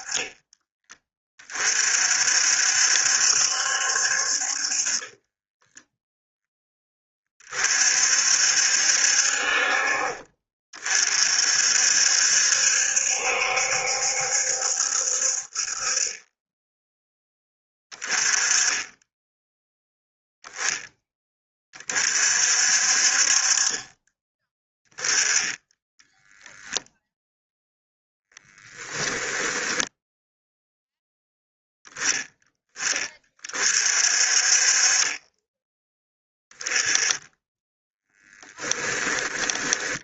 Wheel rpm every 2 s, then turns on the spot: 30, 70, 30, 20, 60, 40, 70, 60, 10, 10, 10, 50, 10, 0, 10, 0, 20, 30, 10, 10.
4-6 28-30